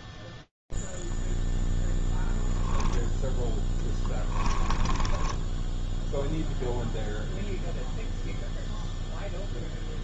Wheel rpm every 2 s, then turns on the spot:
0, 0, 0, 0, 0.
none